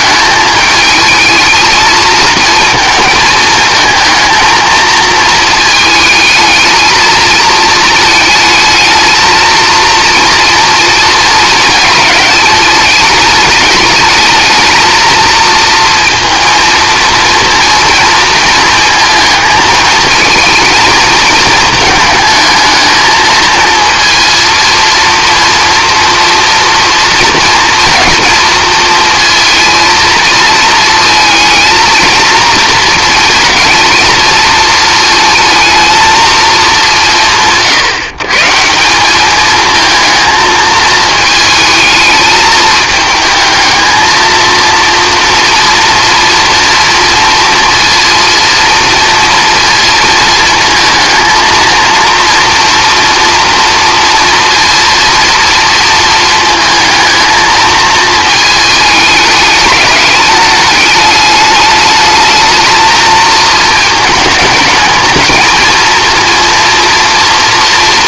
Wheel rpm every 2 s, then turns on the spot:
220, 220, 220, 220, 220, 230, 210, 220, 230, 220, 220, 220, 230, 230, 230, 220, 230, 230, 190, 190, 220, 220, 230, 230, 230, 220, 230, 230, 220, 210, 210, 220, 220, 240.
none